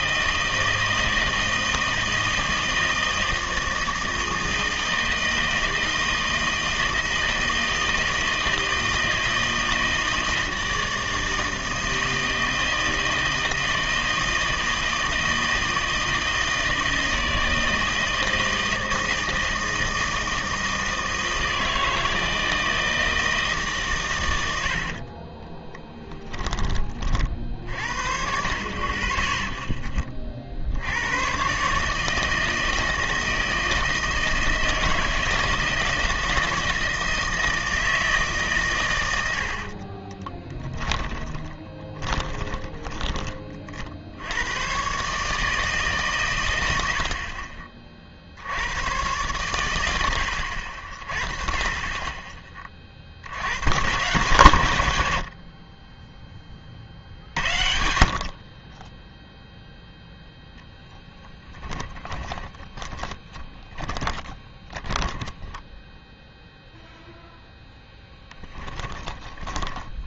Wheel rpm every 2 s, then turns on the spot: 160, 160, 160, 160, 160, 160, 160, 160, 160, 160, 160, 160, 90, 30, 40, 70, 160, 160, 160, 140, 10, 20, 110, 100, 90, 60, 30, 120, 20, 30, 0, 20, 20, 0, 10.
24-28 40-44 62-66 68-70